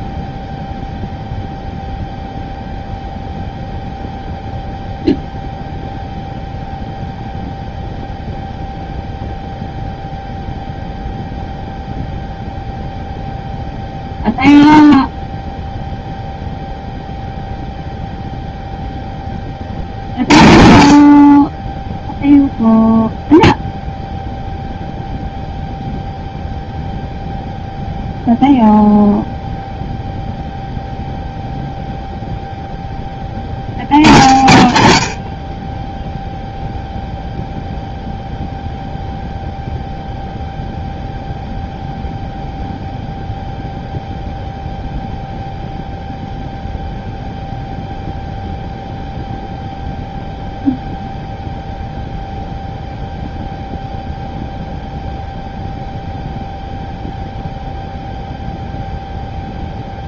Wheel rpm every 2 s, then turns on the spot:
0, 0, 0, 0, 0, 0, 0, 0, 0, 0, 40, 0, 0, 0, 0, 0, 0, 60, 0, 0, 0, 0, 0, 0, 0, 0, 0, 0, 0, 0.
none